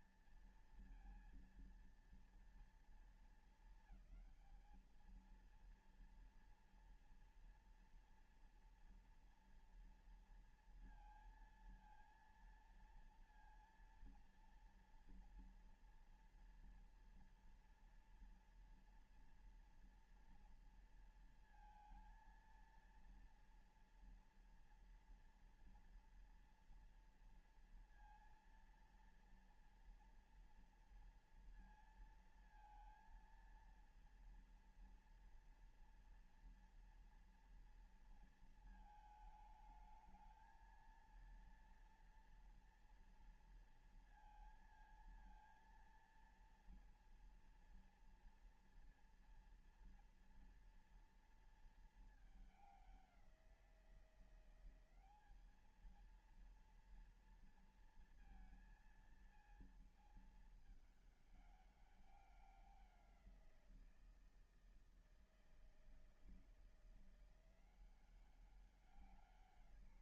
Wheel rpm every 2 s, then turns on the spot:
230, 230, 220, 230, 230, 230, 230, 230, 240, 240, 230, 230, 230, 230, 230, 240, 230, 240, 230, 220, 220, 230, 230, 230, 230, 230, 210, 180, 230, 230, 220, 190, 160, 170, 190.
none